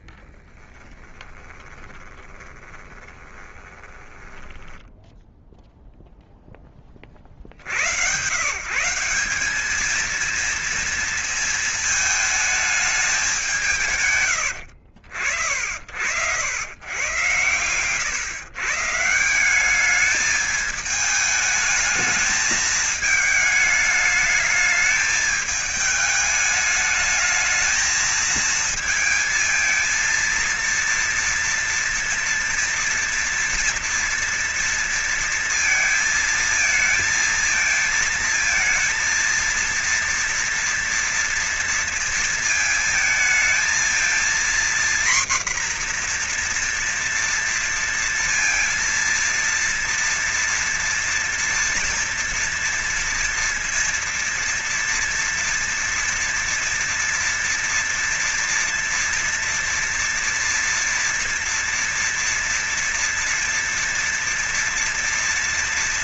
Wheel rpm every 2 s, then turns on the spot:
20, 20, 10, 10, 140, 230, 220, 110, 90, 140, 210, 220, 210, 220, 220, 230, 230, 230, 230, 230, 230, 230, 240, 240, 230, 230, 230, 230, 240, 240, 230, 230, 230.
0-6